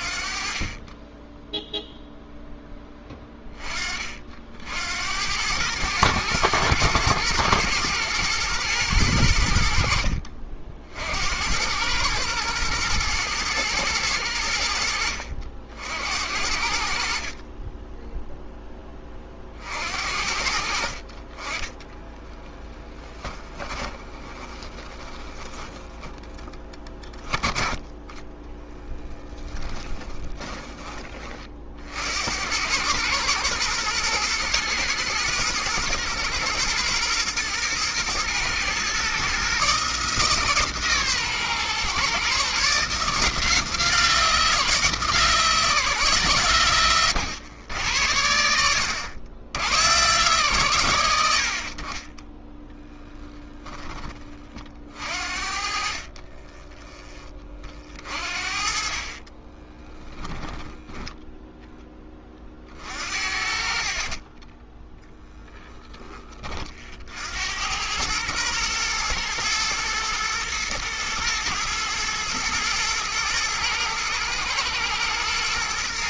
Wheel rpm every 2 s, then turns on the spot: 30, 10, 60, 110, 110, 50, 110, 80, 70, 10, 60, 10, 20, 10, 10, 20, 100, 120, 120, 120, 150, 140, 170, 120, 80, 120, 10, 40, 20, 40, 10, 40, 20, 30, 110, 120, 110, 110.
22-26 28-30 52-54 60-62